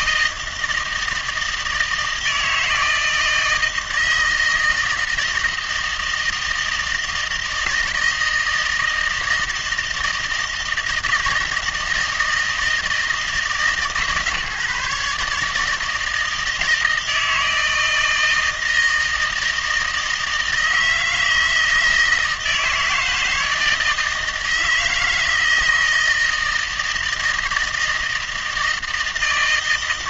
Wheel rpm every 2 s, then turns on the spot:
160, 160, 160, 160, 160, 160, 160, 150, 160, 160, 160, 160, 160, 160, 160.
none